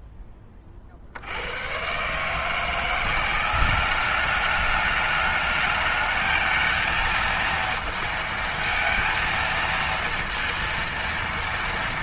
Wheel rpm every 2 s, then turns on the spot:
30, 150, 210, 220, 230, 230.
none